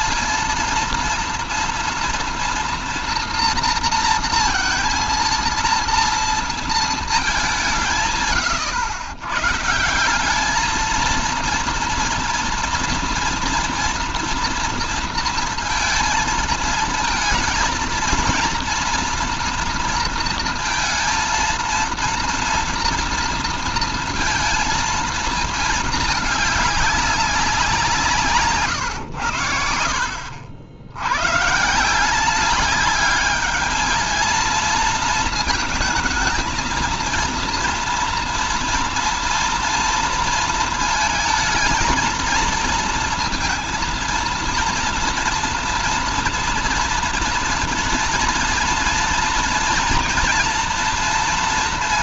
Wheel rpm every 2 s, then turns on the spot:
220, 230, 230, 230, 120, 210, 230, 230, 230, 230, 230, 230, 230, 210, 140, 80, 200, 230, 220, 230, 220, 220, 230, 230, 230, 240.
none